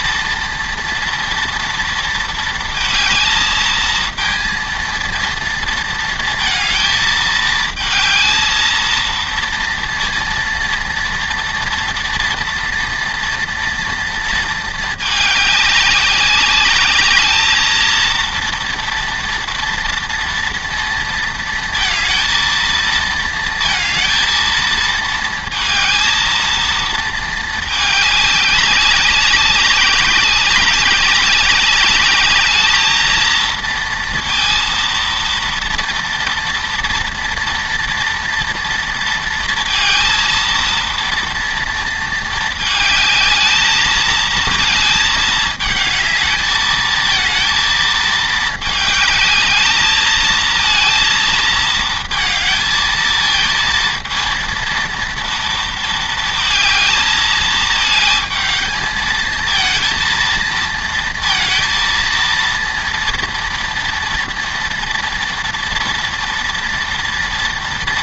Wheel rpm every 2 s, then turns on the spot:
230, 220, 230, 220, 220, 230, 230, 220, 200, 230, 230, 220, 220, 230, 200, 200, 220, 230, 230, 230, 230, 220, 220, 220, 220, 230, 220, 230, 220, 220, 230, 230, 230, 230.
none